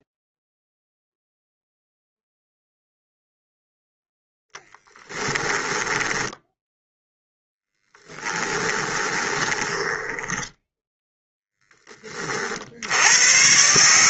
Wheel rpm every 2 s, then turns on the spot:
0, 0, 10, 10, 20, 10, 70.
4-6 8-12